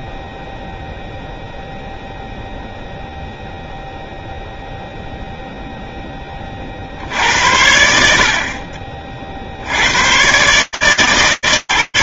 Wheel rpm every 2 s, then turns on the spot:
0, 0, 40, 50, 140, 130.
none